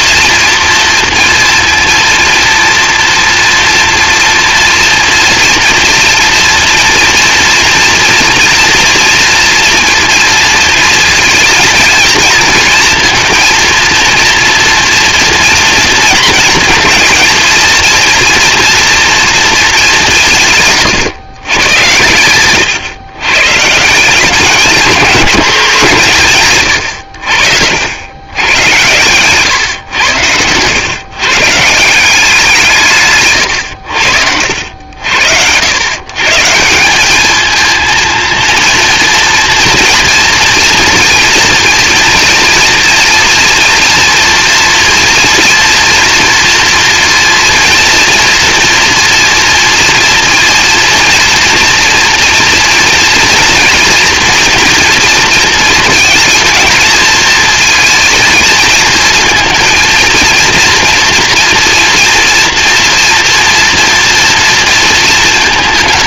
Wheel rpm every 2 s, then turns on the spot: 230, 230, 230, 230, 240, 230, 230, 230, 230, 230, 160, 120, 200, 130, 110, 110, 170, 70, 170, 230, 230, 230, 230, 230, 230, 230, 230, 240, 230, 220, 230, 230, 230.
22-24